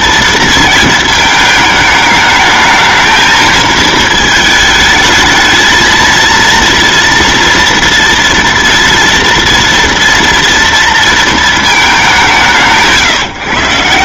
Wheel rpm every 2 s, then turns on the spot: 230, 210, 220, 230, 230, 230, 170.
none